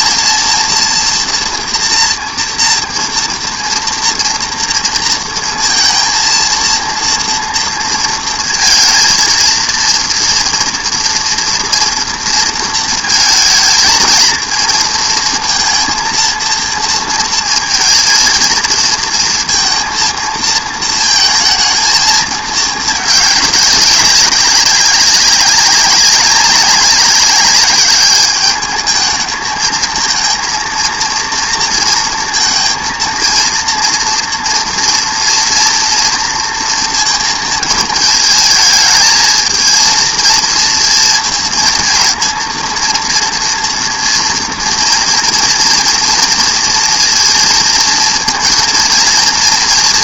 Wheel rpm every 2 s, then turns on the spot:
230, 230, 230, 230, 220, 240, 230, 220, 230, 230, 230, 220, 190, 200, 210, 230, 230, 230, 230, 220, 230, 230, 230, 230, 230.
none